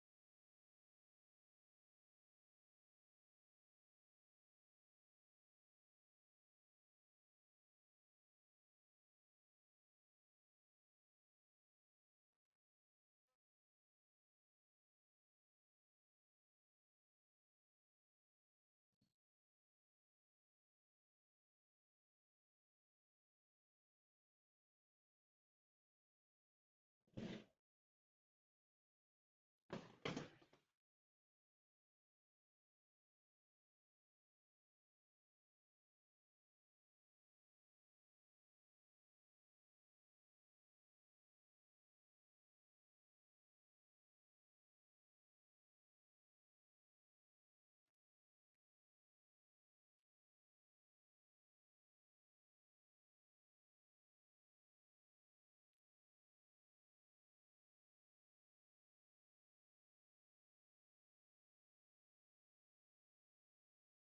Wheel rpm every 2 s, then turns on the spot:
0, 0, 0, 0, 0, 0, 0, 0, 0, 0, 0, 0, 0, 0, 0, 0, 0, 0, 0, 0, 0, 0, 0, 0, 0, 0, 0, 0, 0, 0, 0, 0.
none